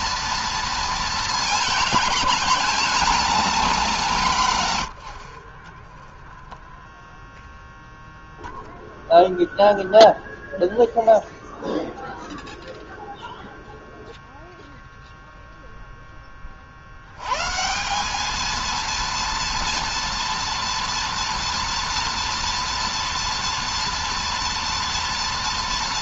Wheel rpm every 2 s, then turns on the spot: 230, 230, 110, 0, 0, 0, 0, 0, 60, 230, 230, 230, 230.
none